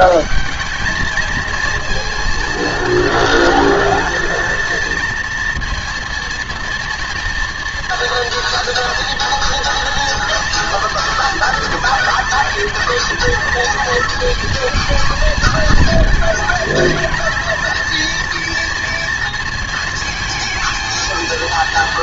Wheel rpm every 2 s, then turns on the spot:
200, 230, 230, 240, 230, 230, 220, 230, 220, 230, 220.
none